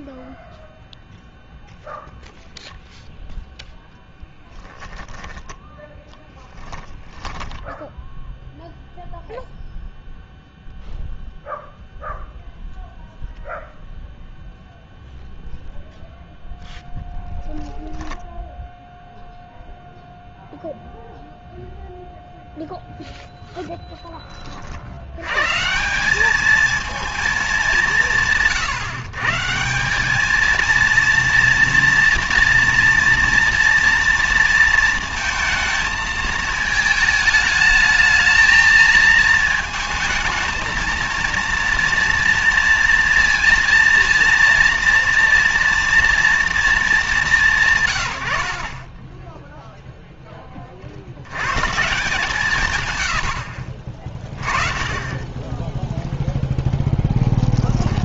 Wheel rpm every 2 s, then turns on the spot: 0, 0, 10, 10, 0, 0, 0, 0, 0, 0, 0, 0, 70, 230, 140, 230, 230, 230, 220, 220, 220, 230, 230, 230, 40, 40, 120, 20, 0.
6-8